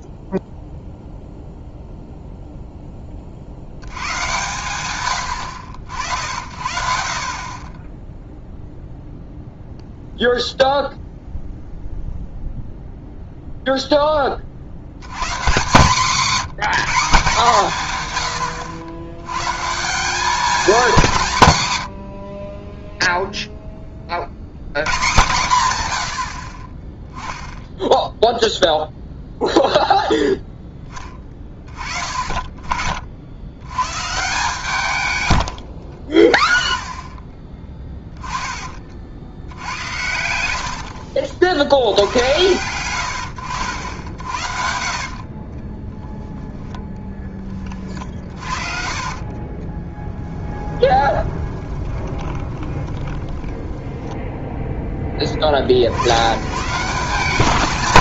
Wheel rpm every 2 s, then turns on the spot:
0, 10, 120, 60, 0, 0, 0, 70, 200, 90, 210, 10, 80, 40, 0, 10, 40, 140, 30, 30, 70, 110, 60, 10, 40, 20, 20, 0, 140.
40-42 44-46 48-54